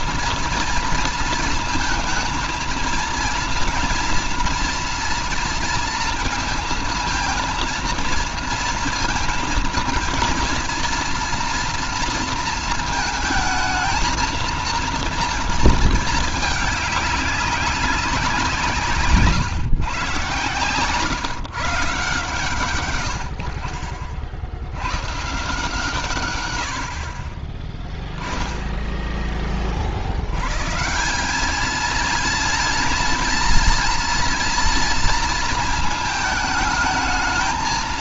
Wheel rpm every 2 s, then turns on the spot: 230, 220, 230, 230, 230, 230, 230, 230, 210, 160, 130, 130, 100, 60, 10, 160, 230, 230, 220.
none